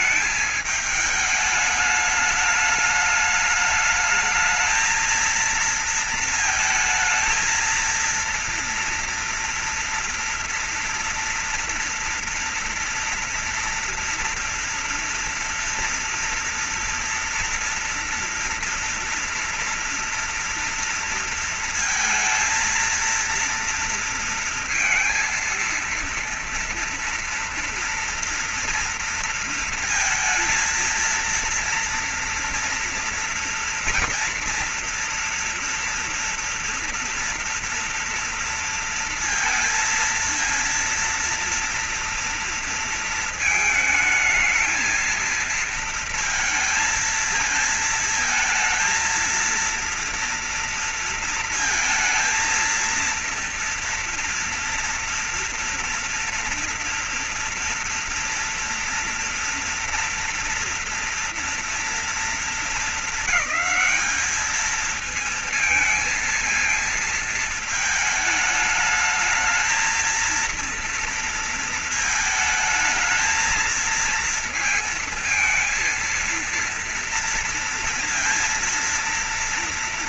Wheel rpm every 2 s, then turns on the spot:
220, 210, 220, 220, 230, 230, 230, 230, 230, 230, 230, 230, 230, 230, 240, 230, 230, 230, 230, 230, 230, 230, 220, 220, 220, 230, 230, 230, 230, 230, 230, 230, 210, 230, 220, 220, 220, 230, 230, 230.
none